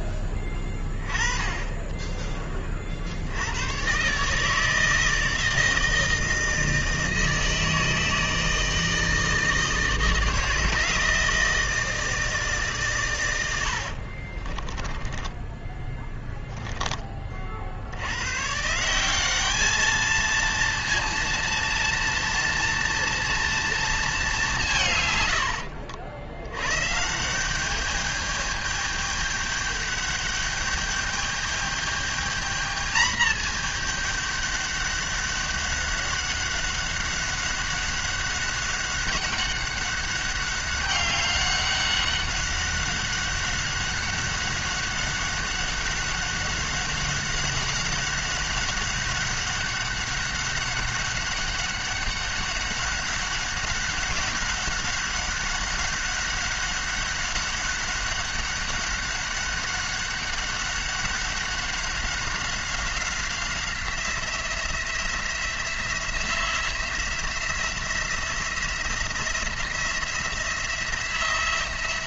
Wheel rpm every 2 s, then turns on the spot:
10, 50, 160, 160, 160, 160, 140, 20, 20, 160, 230, 230, 160, 120, 210, 210, 220, 200, 200, 200, 200, 200, 200, 200, 190, 200, 200, 200, 200, 200, 200, 190, 170, 180, 170, 170.
14-16